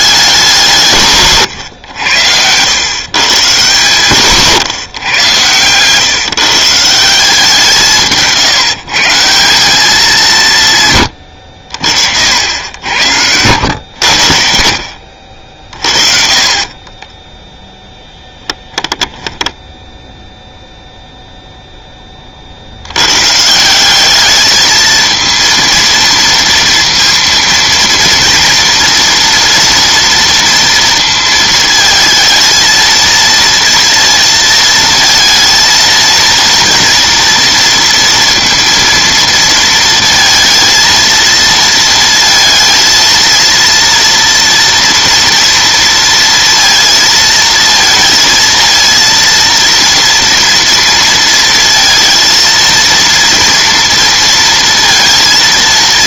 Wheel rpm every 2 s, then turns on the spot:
170, 100, 130, 160, 160, 140, 80, 60, 30, 10, 0, 70, 220, 230, 230, 230, 230, 230, 230, 230, 230, 230, 230, 230, 230, 230, 230, 230.
4-6 16-20